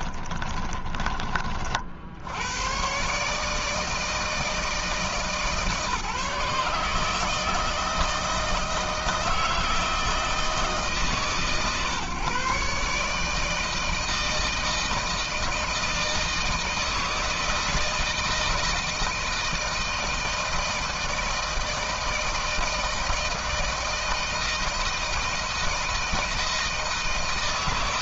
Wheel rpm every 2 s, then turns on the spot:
30, 120, 160, 150, 160, 150, 150, 160, 160, 160, 160, 160, 160, 160.
0-2